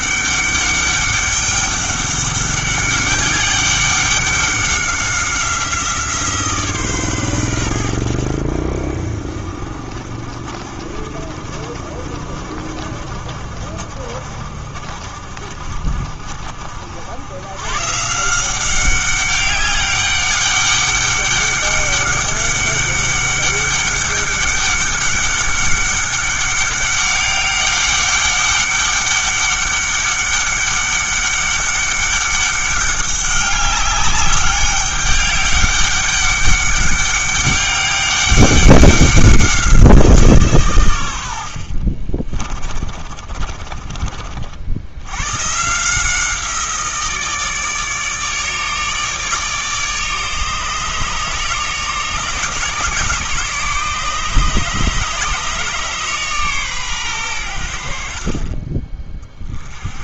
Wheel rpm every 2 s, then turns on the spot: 200, 200, 190, 150, 60, 40, 50, 50, 60, 180, 200, 200, 200, 200, 200, 200, 200, 200, 200, 200, 130, 30, 70, 170, 150, 150, 150, 150, 130, 30.
42-44 58-60